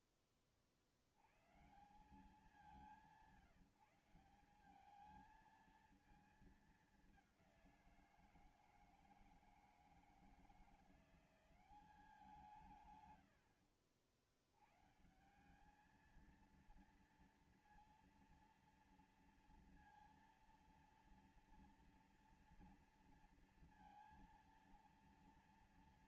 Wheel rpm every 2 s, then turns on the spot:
30, 180, 190, 220, 170, 170, 180, 100, 220, 230, 230, 230, 230.
none